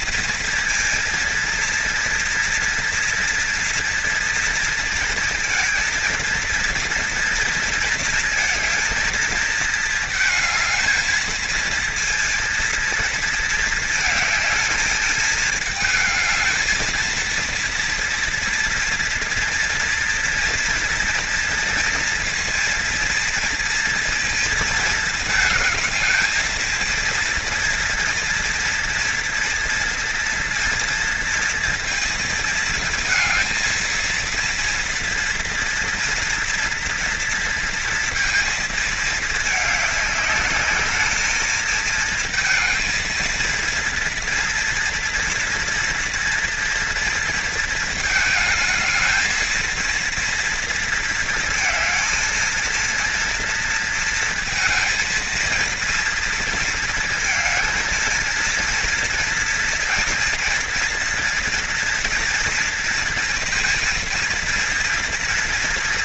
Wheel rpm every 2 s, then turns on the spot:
230, 240, 230, 230, 220, 220, 230, 220, 220, 230, 230, 230, 230, 230, 240, 230, 230, 230, 230, 220, 210, 220, 230, 230, 220, 230, 230, 230, 230, 230, 230, 230, 230.
none